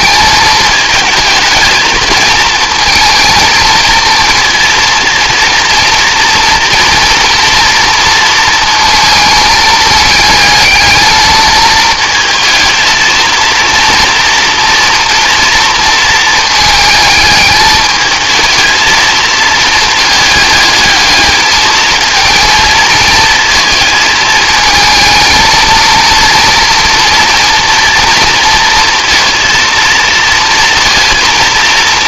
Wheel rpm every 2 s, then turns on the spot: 210, 220, 230, 230, 230, 220, 220, 230, 220, 220, 210, 220, 220, 230, 230, 230.
none